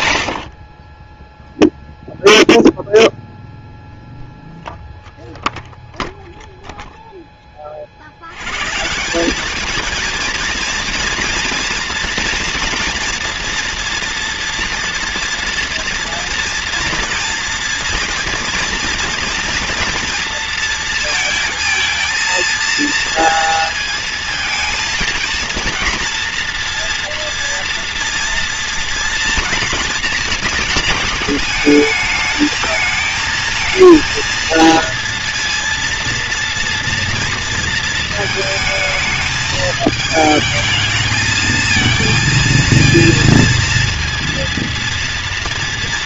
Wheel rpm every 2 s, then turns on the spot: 50, 0, 0, 0, 140, 230, 230, 230, 230, 230, 230, 230, 230, 240, 230, 220, 220, 230, 230, 220, 220, 230, 230.
none